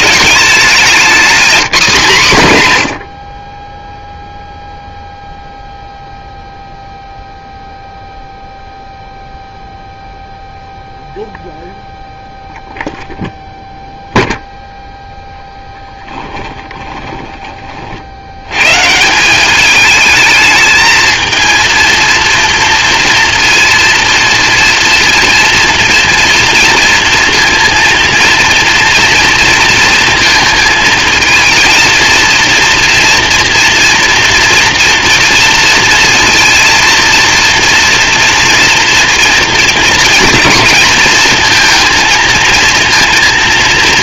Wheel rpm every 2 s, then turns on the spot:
200, 90, 0, 0, 0, 0, 0, 0, 20, 120, 220, 240, 230, 230, 230, 220, 230, 230, 230, 230, 230, 230.
16-18